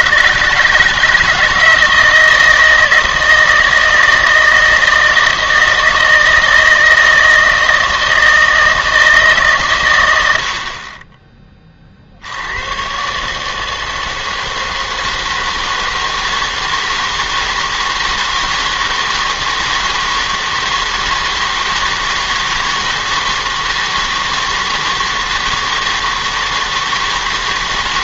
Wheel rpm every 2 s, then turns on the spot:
150, 160, 160, 160, 160, 60, 100, 160, 160, 160, 160, 160, 160, 160.
none